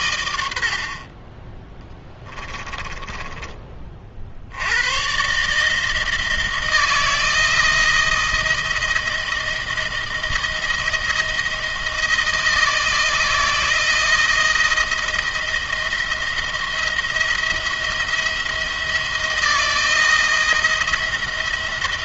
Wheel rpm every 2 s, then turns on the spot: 70, 20, 80, 160, 160, 160, 170, 170, 170, 170, 170.
2-4